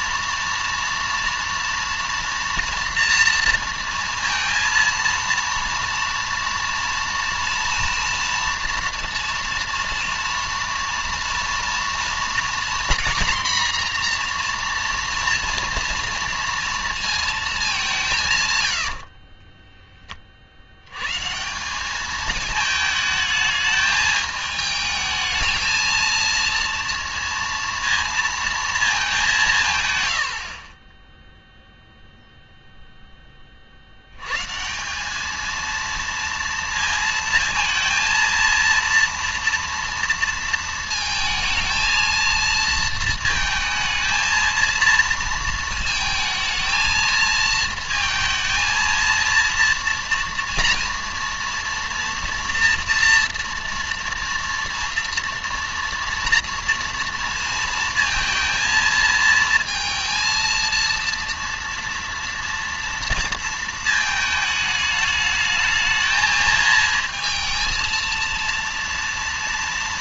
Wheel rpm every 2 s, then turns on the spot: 230, 240, 230, 230, 230, 230, 240, 240, 230, 110, 80, 220, 220, 230, 220, 30, 0, 170, 230, 230, 230, 230, 230, 220, 230, 230, 230, 230, 230, 230, 230, 230, 210, 220, 230.
30-32